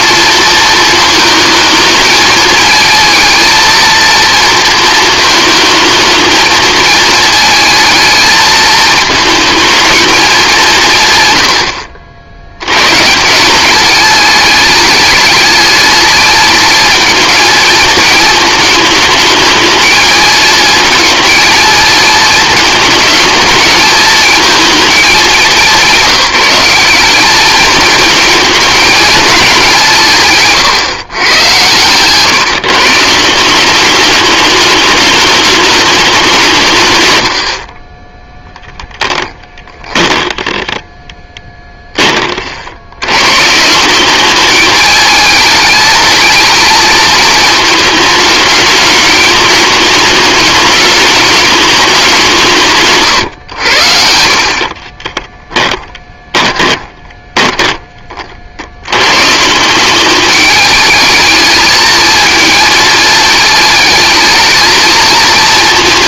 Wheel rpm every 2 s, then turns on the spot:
230, 220, 230, 220, 220, 170, 110, 210, 220, 220, 220, 220, 220, 190, 220, 140, 160, 210, 150, 0, 10, 80, 210, 230, 220, 210, 160, 40, 10, 80, 210, 220, 220.
54-58